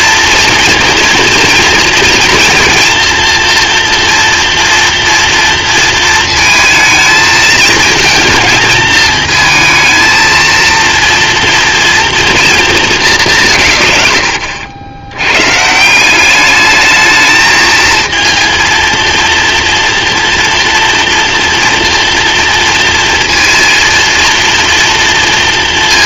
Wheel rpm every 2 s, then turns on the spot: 240, 230, 230, 220, 220, 230, 220, 80, 210, 230, 230, 230, 230.
none